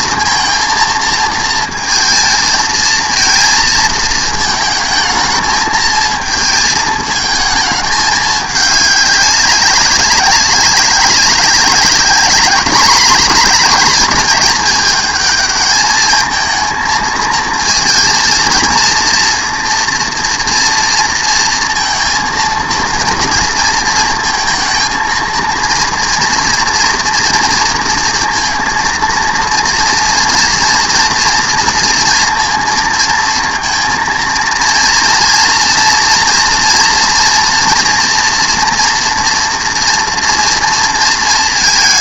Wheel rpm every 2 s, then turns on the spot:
230, 230, 220, 220, 210, 200, 210, 210, 220, 230, 230, 230, 230, 240, 230, 230, 230, 230, 240, 230, 230.
none